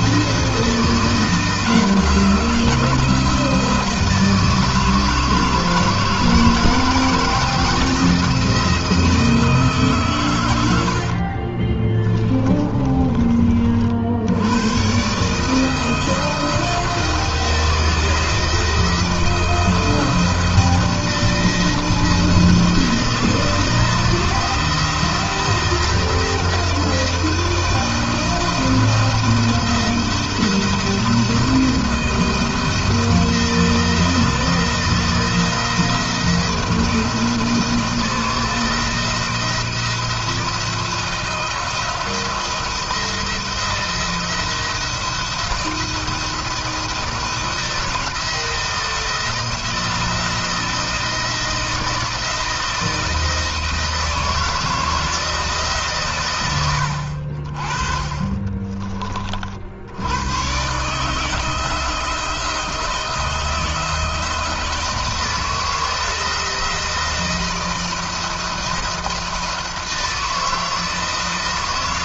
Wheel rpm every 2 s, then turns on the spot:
170, 170, 160, 160, 160, 80, 30, 130, 170, 170, 170, 170, 160, 170, 170, 170, 160, 160, 160, 170, 160, 170, 170, 170, 170, 170, 160, 160, 90, 40, 150, 160, 170, 170, 170, 160.
10-12